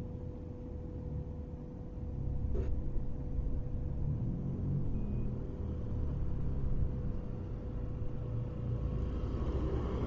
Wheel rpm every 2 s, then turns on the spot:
0, 0, 0, 0, 0.
none